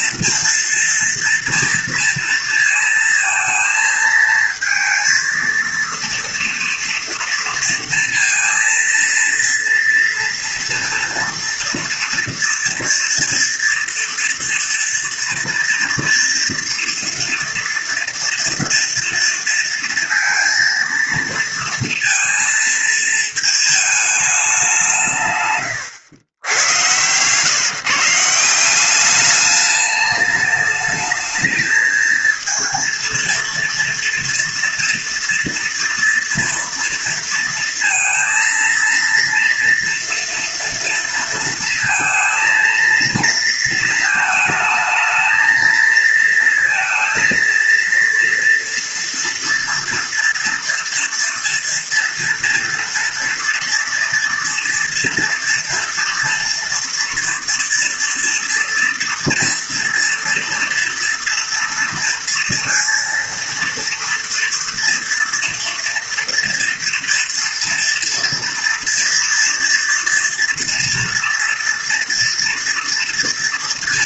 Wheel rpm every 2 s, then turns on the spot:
230, 230, 220, 230, 230, 230, 230, 230, 230, 230, 230, 220, 190, 110, 180, 210, 230, 230, 230, 230, 230, 230, 220, 230, 230, 230, 230, 230, 230, 230, 230, 230, 230, 230, 230, 230, 240.
none